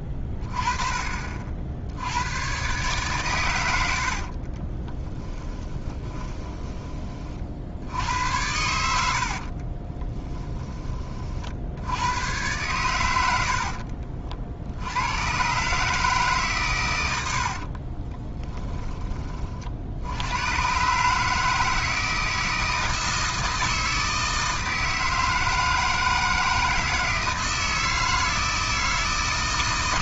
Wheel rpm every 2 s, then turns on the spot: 20, 120, 30, 20, 80, 20, 100, 60, 130, 10, 120, 160, 160, 160, 160.
4-8 18-20